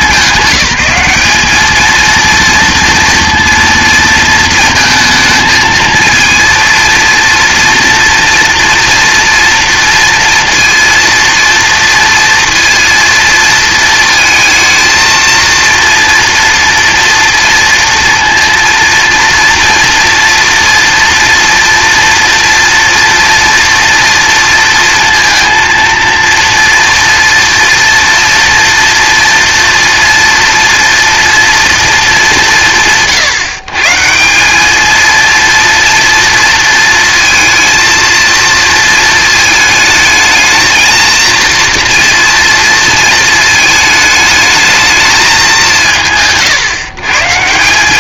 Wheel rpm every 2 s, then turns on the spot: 190, 240, 220, 230, 230, 230, 230, 220, 230, 230, 230, 230, 230, 230, 230, 230, 160, 230, 230, 220, 230, 220, 220, 130.
none